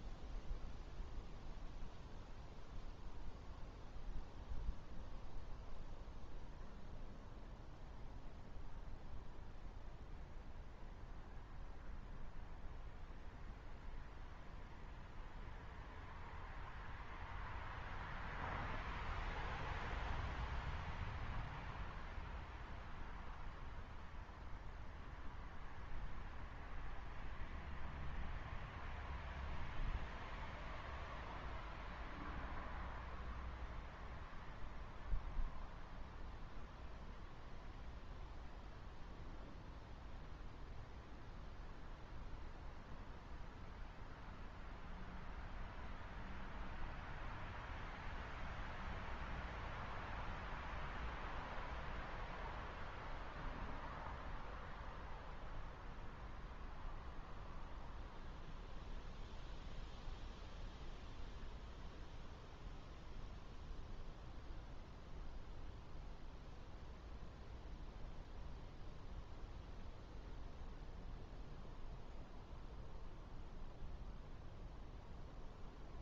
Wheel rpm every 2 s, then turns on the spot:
0, 0, 0, 0, 0, 0, 0, 0, 0, 0, 0, 0, 0, 0, 0, 0, 0, 0, 0, 0, 0, 0, 0, 0, 0, 0, 0, 0, 0, 0, 0, 0, 0, 0, 0, 0, 0, 0.
none